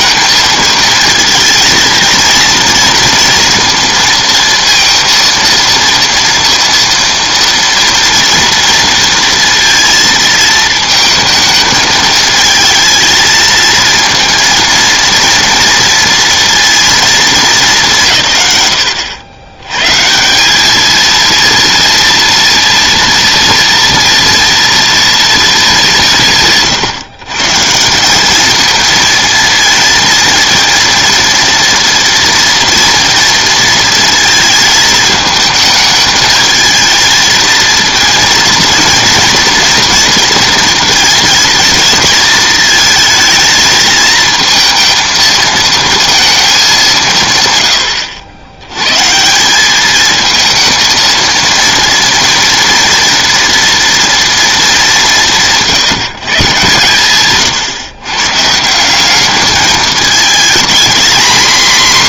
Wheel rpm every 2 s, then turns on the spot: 230, 230, 230, 230, 230, 220, 220, 230, 230, 100, 210, 230, 230, 150, 220, 230, 230, 220, 220, 230, 230, 220, 230, 200, 100, 220, 230, 210, 130, 160, 230.
none